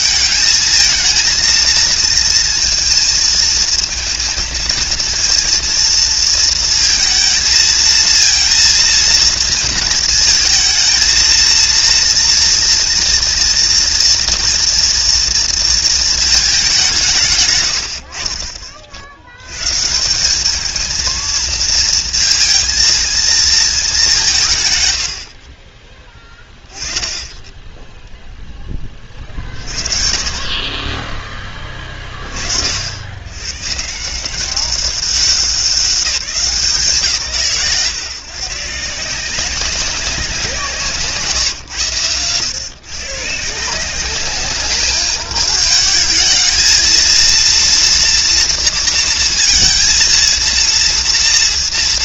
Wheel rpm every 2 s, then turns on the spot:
220, 230, 220, 230, 230, 230, 230, 230, 190, 40, 220, 230, 120, 20, 20, 40, 50, 190, 150, 150, 160, 130, 210, 220, 230, 230.
none